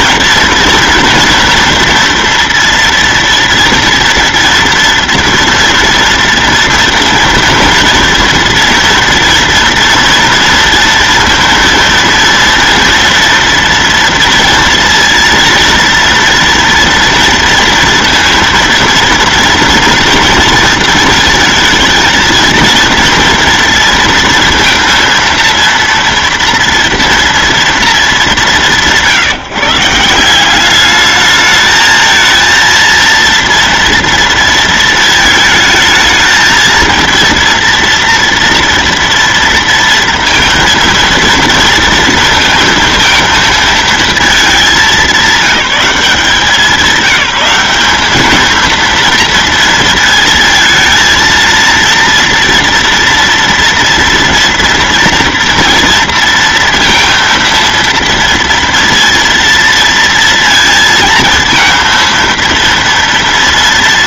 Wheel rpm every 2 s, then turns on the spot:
230, 230, 230, 230, 230, 230, 230, 230, 230, 230, 230, 230, 230, 230, 170, 200, 230, 230, 220, 230, 230, 230, 210, 180, 230, 220, 240, 230, 230, 230, 230, 230.
none